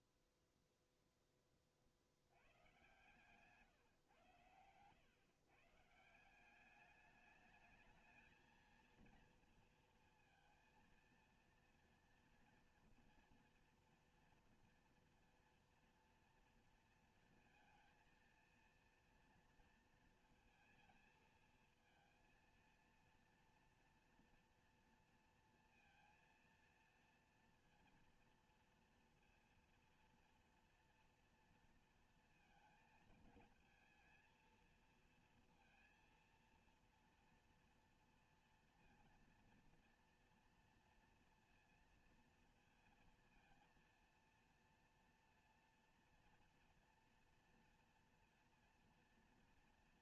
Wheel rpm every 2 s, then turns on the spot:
0, 90, 120, 180, 220, 230, 230, 230, 230, 230, 230, 230, 230, 230, 230, 230, 230, 230, 230, 230, 230, 230, 230, 240, 240.
none